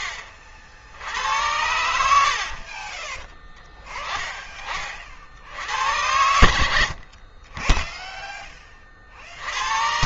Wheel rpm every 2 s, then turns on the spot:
60, 50, 20, 70, 20.
2-4